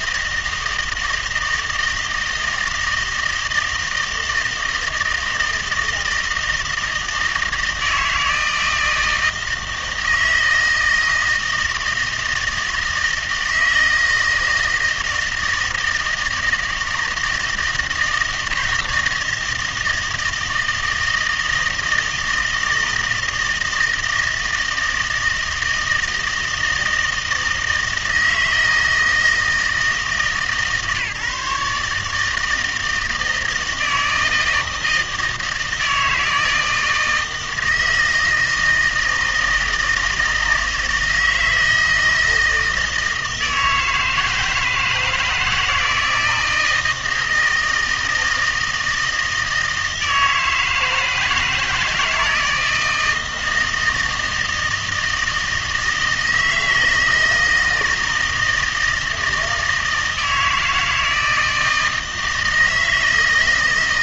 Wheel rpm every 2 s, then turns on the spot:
160, 160, 160, 160, 160, 160, 160, 160, 160, 160, 160, 160, 160, 160, 160, 150, 160, 160, 160, 160, 160, 160, 160, 170, 160, 160, 160, 160, 160, 160, 160, 160.
none